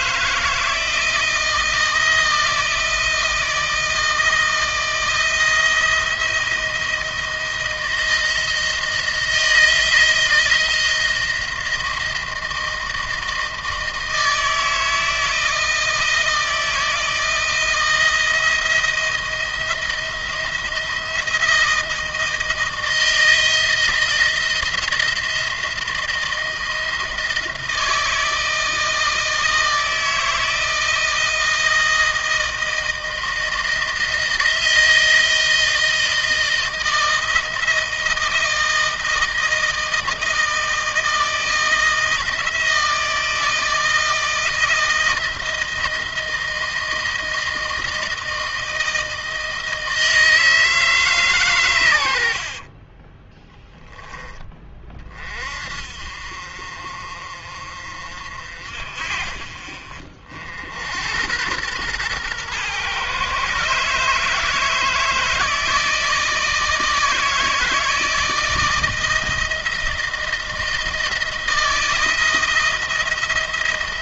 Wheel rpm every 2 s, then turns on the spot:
170, 160, 160, 160, 160, 160, 160, 160, 160, 170, 170, 160, 170, 160, 160, 160, 160, 160, 160, 160, 160, 160, 160, 160, 160, 150, 20, 30, 50, 50, 80, 120, 160, 160, 160, 160, 170.
52-54